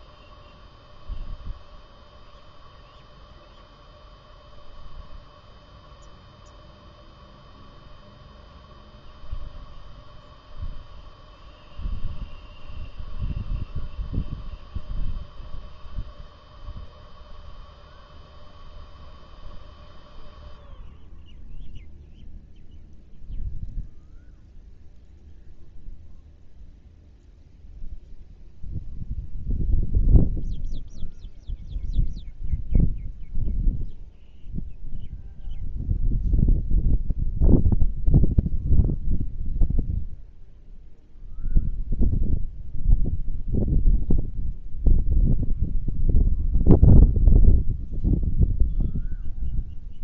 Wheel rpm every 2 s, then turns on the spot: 0, 0, 0, 0, 0, 0, 0, 0, 0, 0, 0, 0, 0, 0, 0, 0, 0, 0, 0, 0, 0, 0, 0, 0, 0.
none